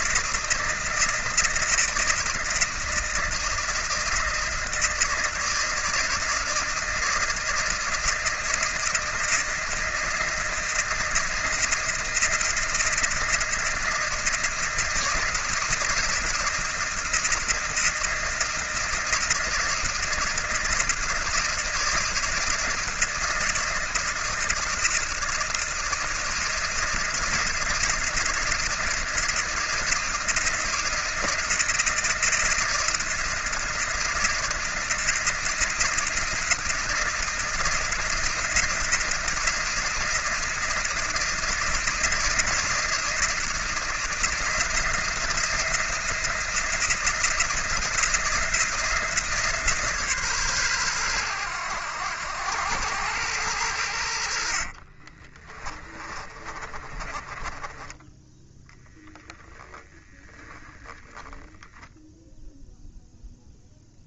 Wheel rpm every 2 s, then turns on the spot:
160, 160, 160, 160, 160, 160, 160, 160, 160, 160, 160, 160, 160, 160, 160, 160, 160, 160, 170, 160, 160, 160, 170, 170, 170, 120, 90, 50, 20, 0, 0, 0.
54-58